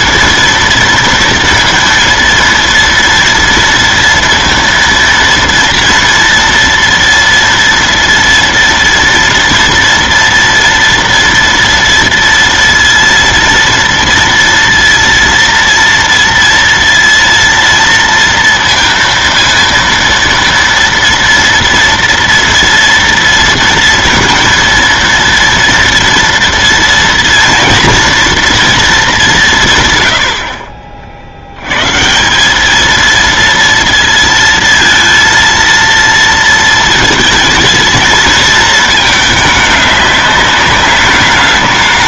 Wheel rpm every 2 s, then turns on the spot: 230, 230, 230, 240, 230, 230, 230, 230, 230, 230, 230, 230, 230, 230, 230, 80, 170, 230, 230, 220, 200.
30-32